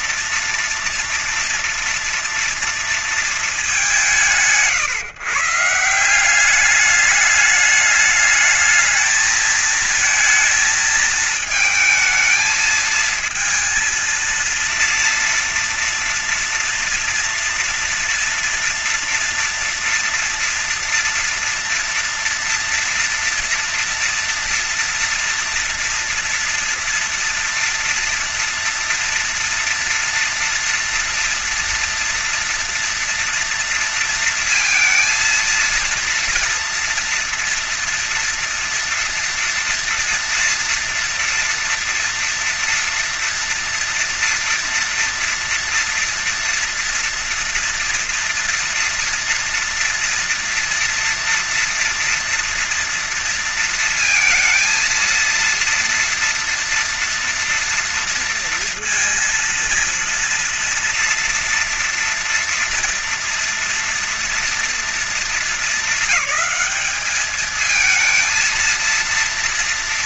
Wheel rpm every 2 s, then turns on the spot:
230, 230, 180, 190, 220, 220, 220, 230, 230, 240, 230, 230, 230, 230, 230, 230, 230, 230, 230, 230, 230, 230, 230, 230, 240, 230, 230, 230, 230, 230, 230, 230, 230, 210, 230.
none